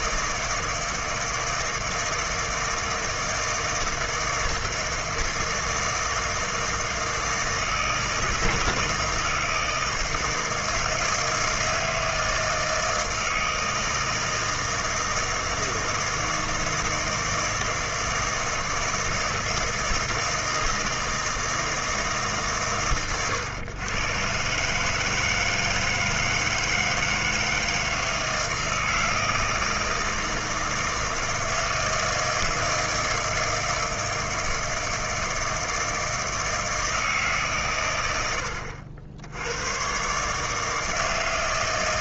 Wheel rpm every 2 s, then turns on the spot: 160, 160, 160, 160, 160, 160, 160, 160, 160, 160, 160, 130, 150, 160, 160, 160, 160, 160, 160, 70, 160.
none